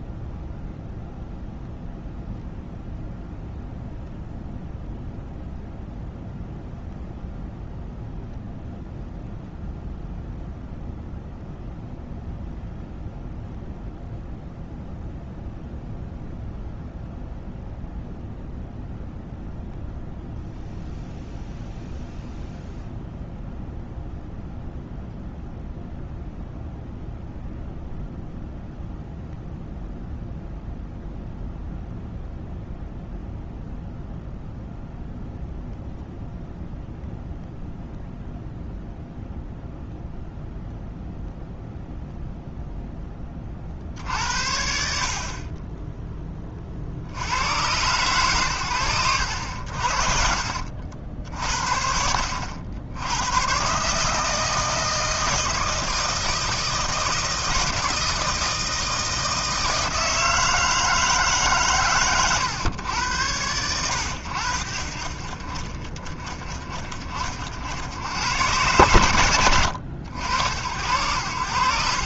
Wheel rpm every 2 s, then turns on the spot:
0, 0, 0, 0, 0, 0, 0, 0, 0, 0, 0, 0, 0, 0, 0, 0, 0, 0, 0, 0, 0, 0, 60, 50, 100, 70, 80, 160, 160, 160, 160, 110, 50, 30, 110, 80.
none